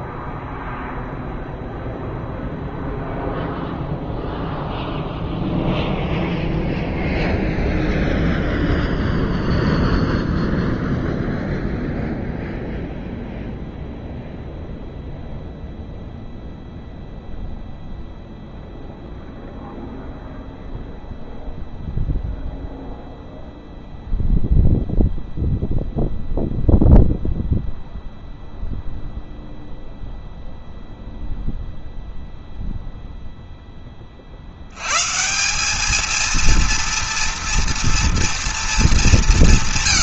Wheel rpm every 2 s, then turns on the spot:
0, 0, 0, 0, 0, 0, 0, 0, 0, 0, 0, 0, 0, 0, 0, 0, 0, 50, 220, 230.
none